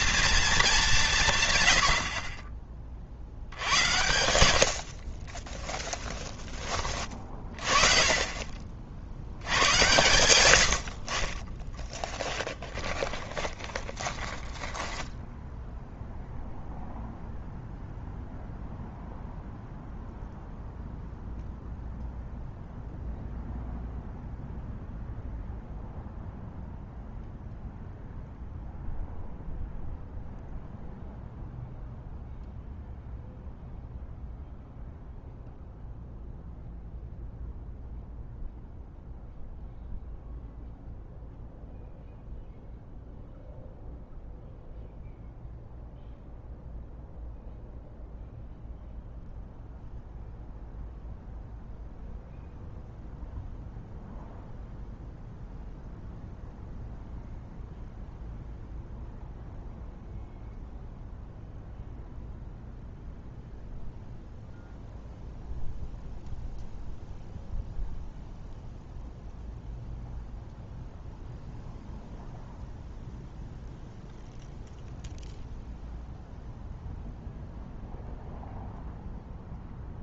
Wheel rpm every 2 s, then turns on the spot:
220, 40, 70, 20, 40, 90, 10, 10, 0, 0, 0, 0, 0, 0, 0, 0, 0, 0, 0, 0, 0, 0, 0, 0, 0, 0, 0, 0, 0, 0, 0, 0, 0, 0, 0, 0, 0, 0, 0, 0.
2-4 12-16